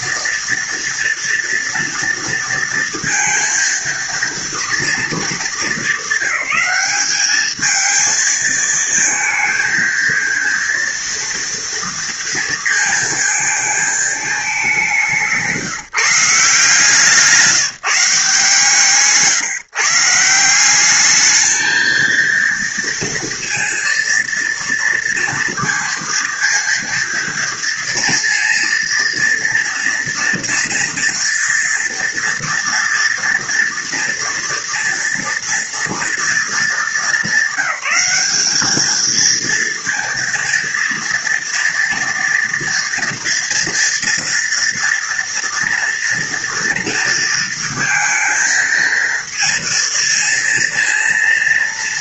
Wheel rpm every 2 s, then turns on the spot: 230, 230, 230, 200, 220, 230, 230, 210, 170, 160, 180, 230, 230, 230, 230, 230, 240, 240, 220, 200, 230, 230, 230, 240, 230, 230.
none